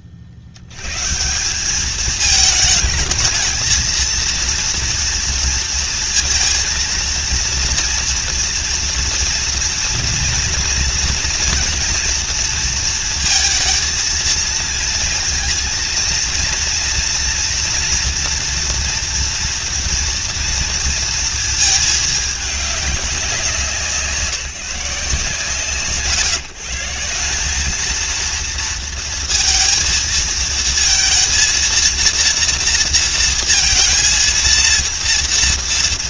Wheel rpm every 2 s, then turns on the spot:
70, 220, 230, 230, 230, 240, 230, 230, 230, 230, 230, 200, 160, 150, 230, 230, 230, 230.
none